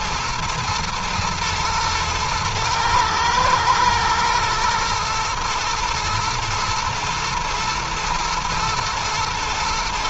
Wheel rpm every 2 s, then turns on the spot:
120, 110, 120, 120, 120.
none